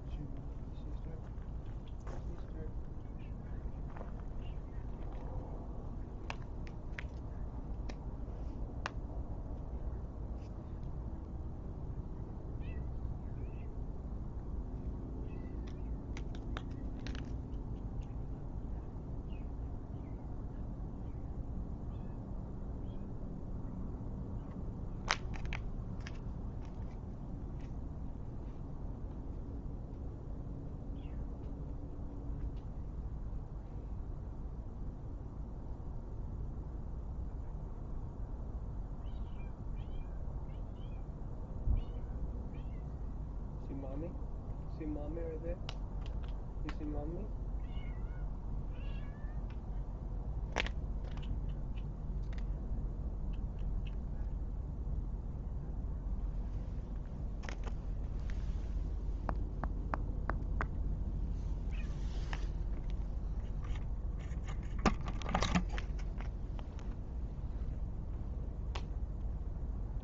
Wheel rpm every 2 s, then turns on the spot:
0, 0, 0, 0, 0, 0, 0, 0, 0, 0, 0, 0, 0, 0, 0, 0, 0, 0, 0, 0, 0, 0, 0, 0, 0, 0, 0, 0, 0, 0, 0, 0, 0, 0, 0.
none